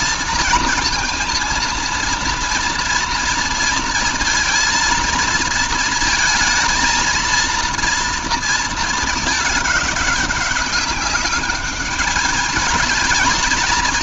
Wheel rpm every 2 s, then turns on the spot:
230, 230, 230, 230, 220, 200, 220.
none